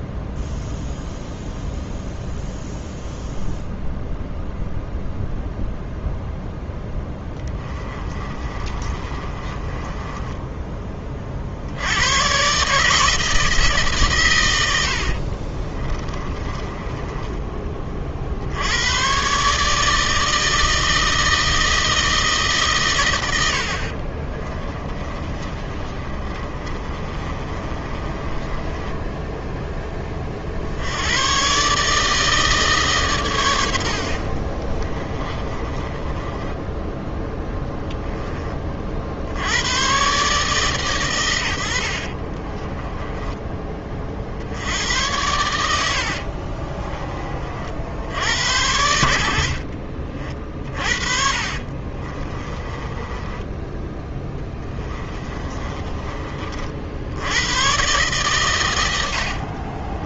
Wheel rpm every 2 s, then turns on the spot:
0, 0, 0, 10, 30, 30, 160, 80, 20, 110, 160, 120, 30, 30, 10, 80, 150, 30, 10, 40, 130, 20, 90, 30, 70, 40, 20, 20, 70, 90.
6-10 14-18 24-30 34-38 42-44 46-48 50-56